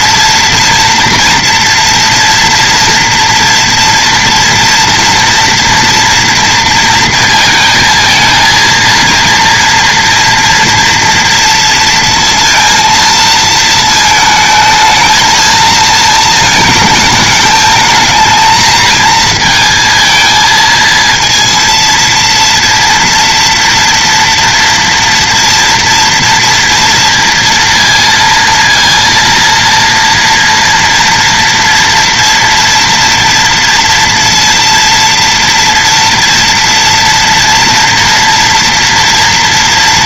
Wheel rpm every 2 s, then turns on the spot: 230, 230, 230, 230, 230, 230, 230, 220, 230, 220, 220, 230, 230, 230, 230, 230, 240, 230, 230, 230.
none